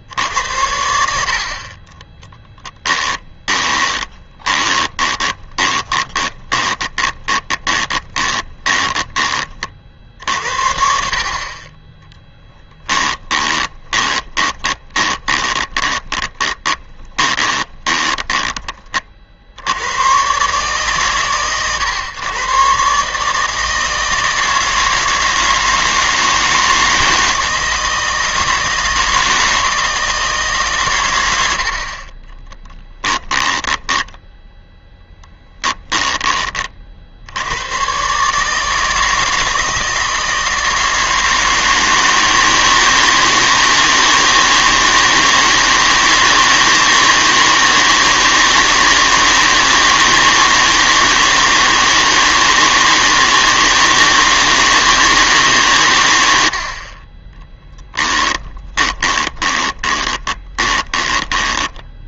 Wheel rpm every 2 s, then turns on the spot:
90, 10, 20, 20, 20, 60, 10, 20, 20, 30, 140, 130, 160, 160, 160, 140, 10, 10, 30, 160, 160, 160, 160, 160, 160, 160, 160, 160, 70, 10, 20.
2-10 12-18 32-34 58-62